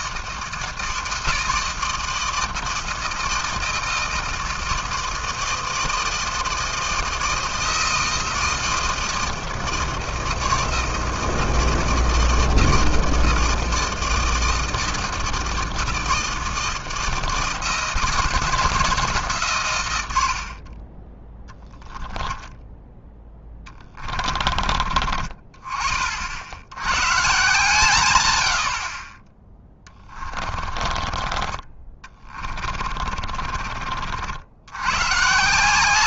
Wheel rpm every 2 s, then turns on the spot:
160, 170, 160, 160, 160, 160, 160, 160, 160, 140, 10, 10, 40, 140, 20, 30, 30, 140.
22-24 30-34